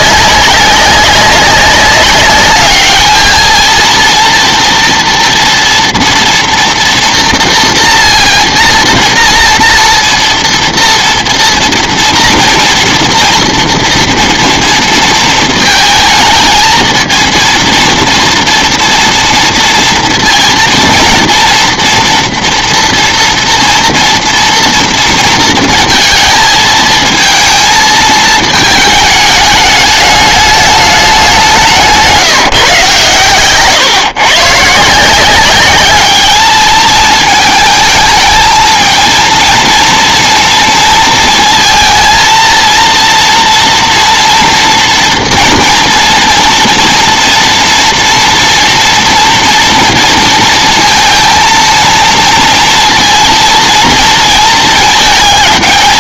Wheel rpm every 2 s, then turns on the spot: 190, 210, 230, 230, 240, 230, 230, 240, 220, 230, 230, 230, 230, 220, 220, 210, 150, 140, 210, 220, 230, 230, 230, 230, 230, 230, 230, 230.
none